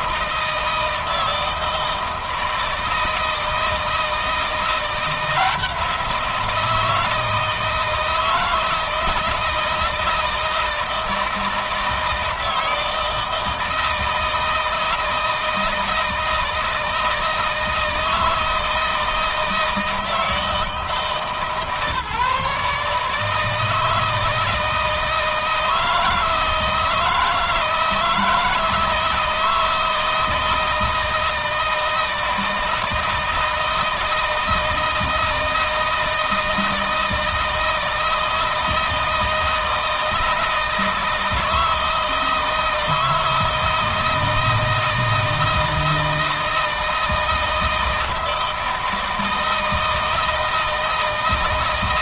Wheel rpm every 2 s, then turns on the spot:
160, 160, 170, 160, 160, 160, 160, 160, 160, 160, 160, 150, 160, 160, 160, 160, 160, 160, 160, 160, 160, 160, 160, 160, 160, 160.
none